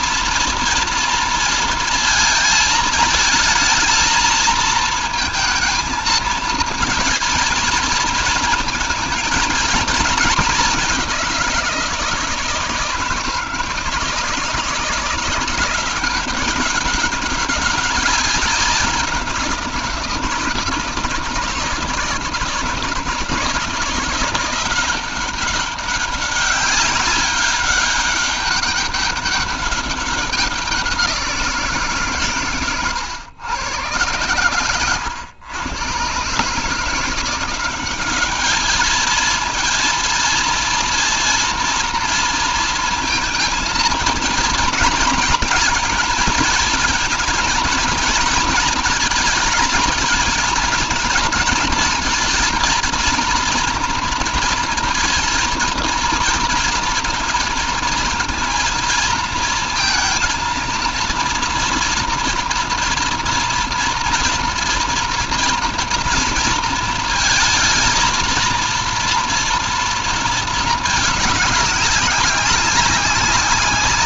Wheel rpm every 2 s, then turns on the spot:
230, 220, 230, 220, 220, 190, 160, 170, 190, 190, 160, 160, 180, 200, 200, 190, 120, 110, 160, 220, 230, 230, 230, 230, 230, 230, 230, 230, 230, 230, 230, 230, 230, 230, 230, 220, 200.
none